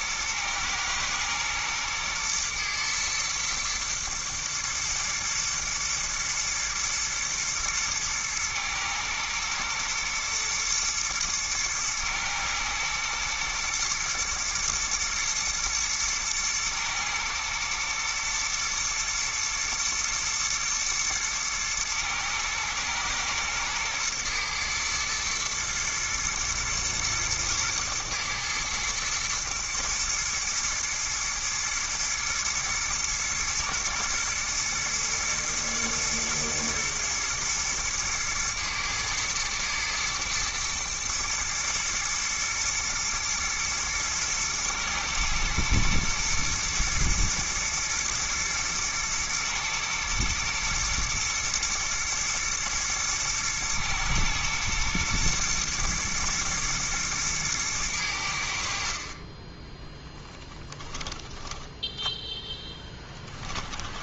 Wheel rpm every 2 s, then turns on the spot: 110, 110, 120, 110, 110, 120, 110, 110, 110, 120, 120, 110, 110, 120, 110, 110, 110, 110, 110, 110, 110, 120, 110, 110, 110, 120, 110, 110, 110, 60, 10, 10.
60-64